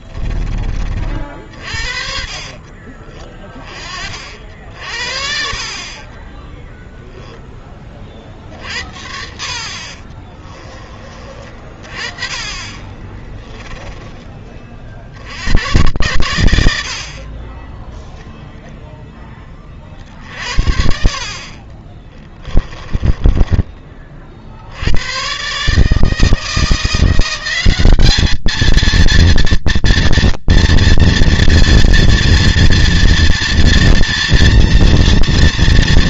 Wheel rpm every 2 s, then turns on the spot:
40, 40, 50, 0, 60, 30, 20, 50, 70, 10, 70, 20, 80, 170, 230, 230, 230, 230.
8-10 12-14 22-24